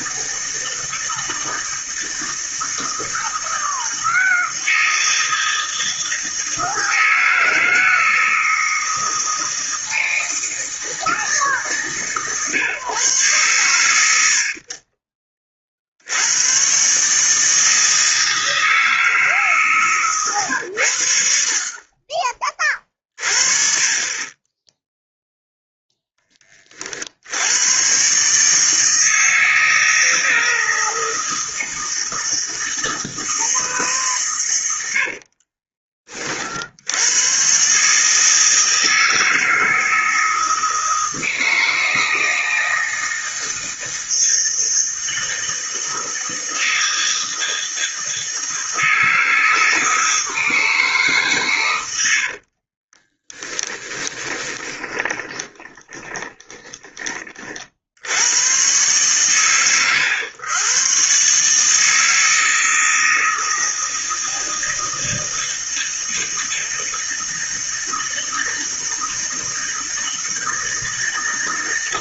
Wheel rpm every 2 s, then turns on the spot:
160, 160, 160, 160, 160, 160, 140, 40, 130, 160, 100, 30, 10, 40, 160, 160, 160, 90, 70, 160, 160, 160, 160, 160, 160, 160, 40, 20, 20, 120, 120, 160, 160, 160, 160, 160.
52-58